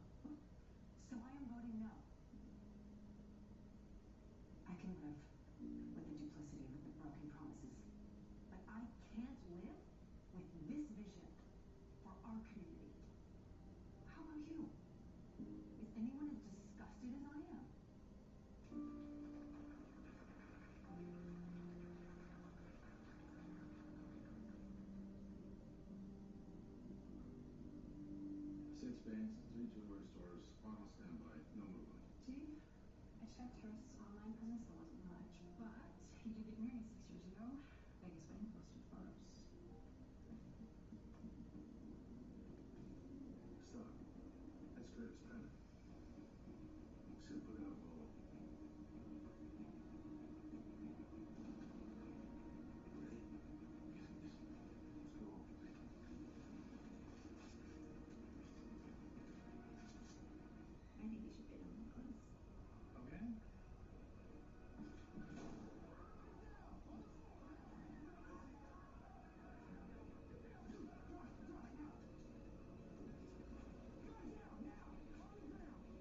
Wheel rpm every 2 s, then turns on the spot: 0, 0, 0, 0, 0, 0, 0, 0, 0, 0, 0, 0, 0, 0, 0, 0, 0, 0, 0, 0, 0, 0, 0, 0, 0, 0, 0, 0, 0, 0, 0, 0, 0, 0, 0, 0, 0, 0.
none